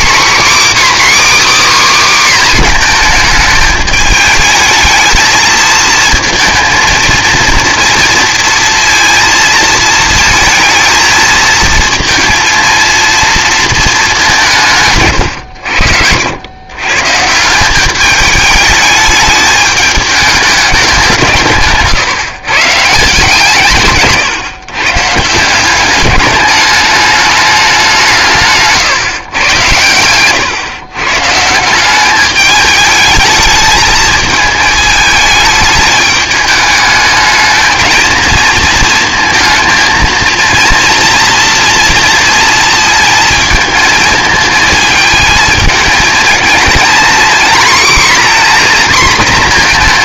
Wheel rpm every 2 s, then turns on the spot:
290, 250, 220, 230, 230, 220, 230, 160, 110, 210, 200, 140, 140, 210, 140, 130, 210, 220, 210, 220, 230, 220, 220, 230, 250.
none